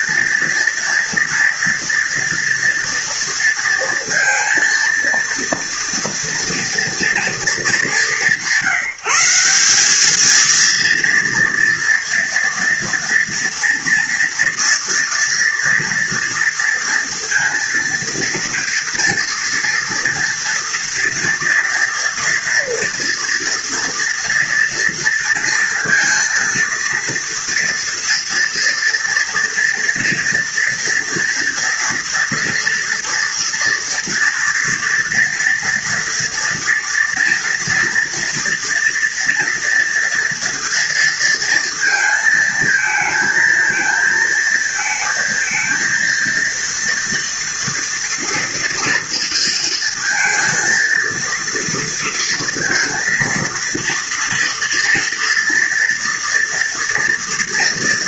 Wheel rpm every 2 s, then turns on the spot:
230, 230, 230, 210, 180, 230, 230, 230, 230, 230, 230, 230, 230, 230, 230, 230, 240, 240, 230, 230, 230, 230, 230, 230, 230, 230, 230, 230, 230.
none